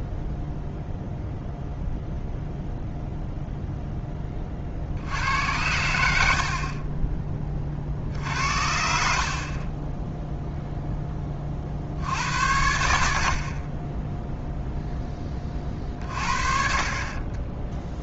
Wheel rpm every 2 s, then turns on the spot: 0, 0, 20, 70, 70, 0, 70, 0, 50.
none